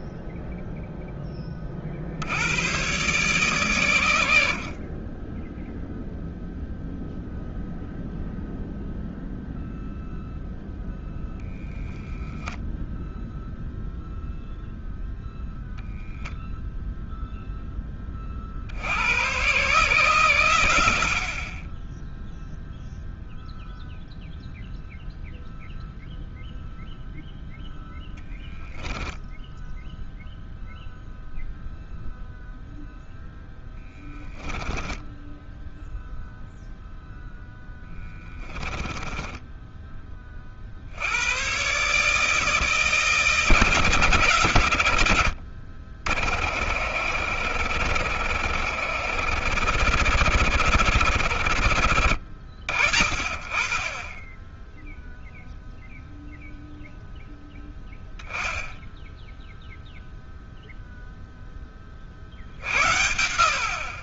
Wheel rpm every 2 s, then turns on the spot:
0, 100, 60, 0, 0, 0, 0, 0, 0, 60, 120, 0, 0, 0, 10, 0, 0, 10, 0, 20, 60, 160, 130, 60, 80, 100, 80, 10, 0, 10, 0, 60.
28-30 34-36 38-40